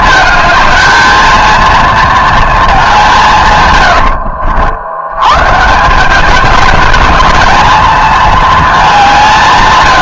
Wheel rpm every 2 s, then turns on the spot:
220, 210, 80, 210, 210.
none